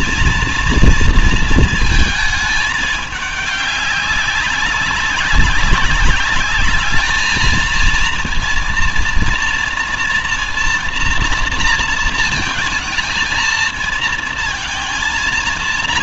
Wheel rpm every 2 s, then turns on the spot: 230, 210, 190, 200, 230, 240, 230, 230.
none